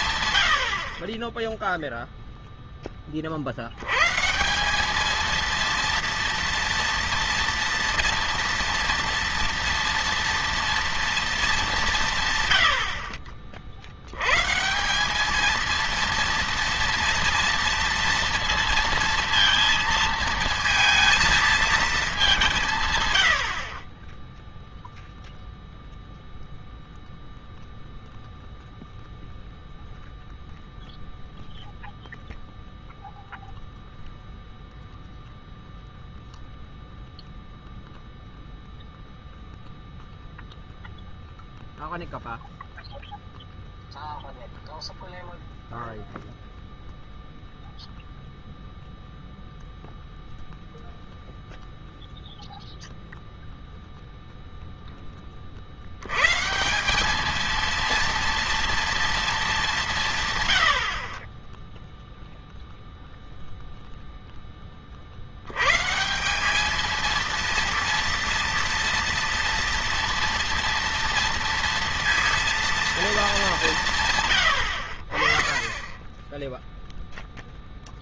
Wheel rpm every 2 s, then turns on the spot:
80, 10, 180, 230, 230, 230, 110, 140, 230, 230, 230, 170, 0, 0, 0, 0, 0, 0, 0, 0, 0, 0, 0, 0, 0, 0, 0, 0, 160, 230, 110, 0, 20, 210, 230, 230, 230, 90, 0.
none